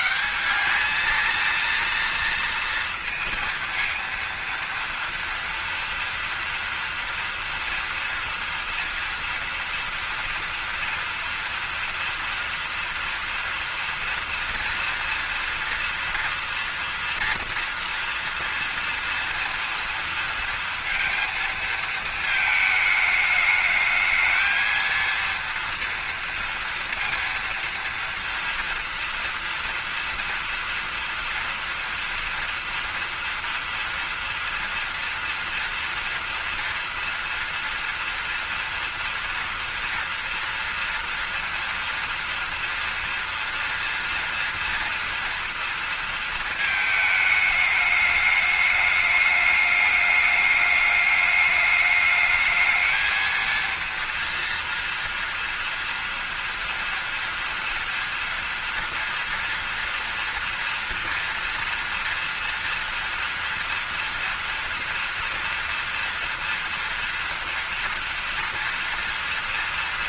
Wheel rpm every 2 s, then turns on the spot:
220, 230, 230, 230, 230, 230, 230, 240, 230, 230, 230, 220, 230, 230, 230, 230, 230, 230, 230, 230, 230, 230, 240, 220, 210, 210, 220, 230, 230, 230, 230, 230, 230, 240, 230.
none